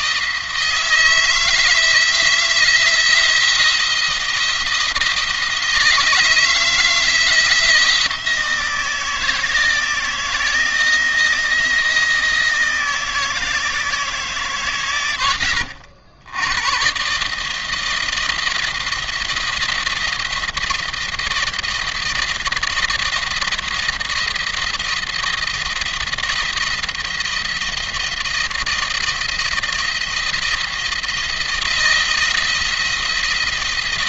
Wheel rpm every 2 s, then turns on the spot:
160, 170, 160, 160, 170, 170, 160, 140, 120, 170, 170, 170, 170, 170, 170, 170, 170.
none